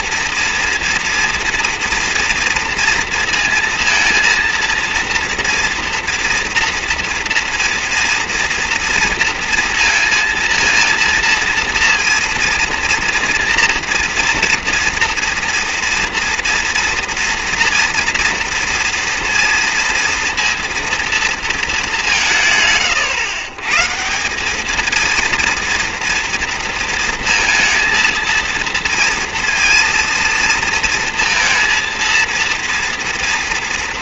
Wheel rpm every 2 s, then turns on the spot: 230, 230, 230, 230, 230, 230, 230, 230, 230, 230, 230, 140, 210, 230, 230, 230, 230.
none